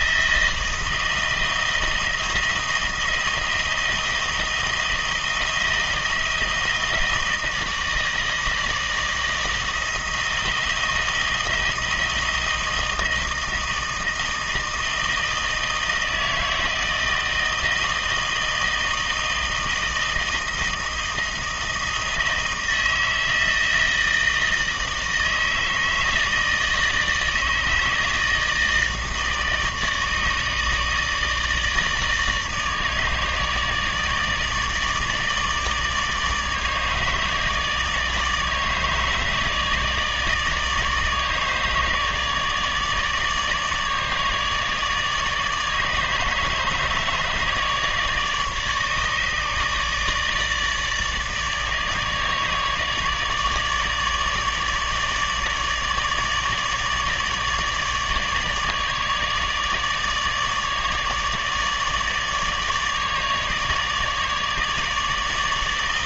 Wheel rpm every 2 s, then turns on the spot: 160, 160, 160, 160, 160, 160, 160, 160, 160, 160, 160, 160, 160, 160, 160, 150, 150, 150, 150, 160, 150, 150, 150, 150, 150, 150, 150, 150, 150, 150, 150, 150, 150.
none